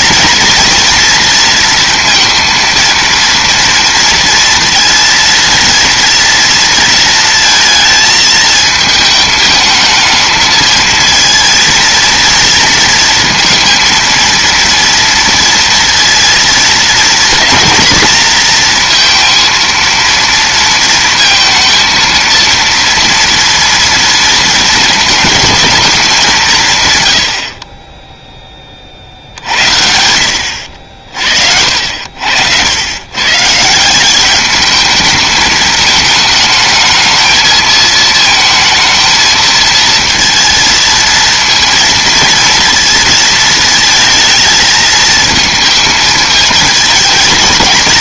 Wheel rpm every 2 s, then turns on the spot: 230, 230, 230, 230, 220, 220, 230, 230, 230, 230, 230, 230, 230, 150, 20, 70, 90, 210, 220, 230, 230, 230, 220, 220.
30-32